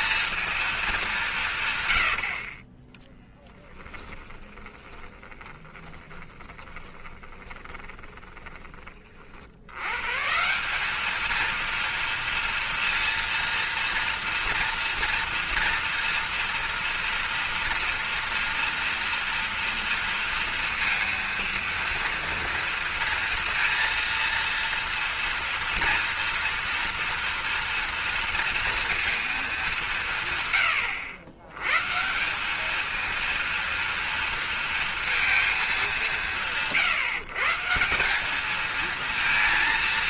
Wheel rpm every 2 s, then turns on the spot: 230, 140, 10, 10, 10, 90, 220, 230, 230, 230, 230, 230, 230, 230, 230, 200, 120, 230, 220, 150.
4-10